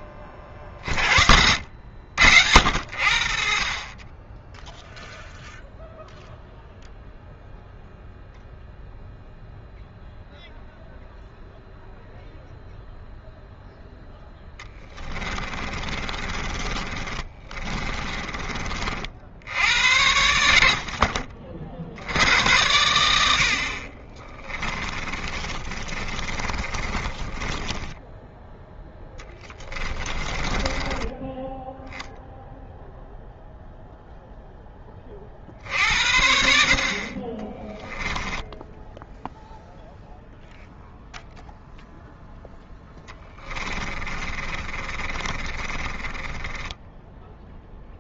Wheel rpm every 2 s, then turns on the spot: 40, 70, 0, 0, 0, 0, 0, 10, 30, 50, 60, 100, 20, 30, 10, 20, 0, 20, 50, 10, 0, 10, 30, 10.
14-18 24-28 30-32 42-48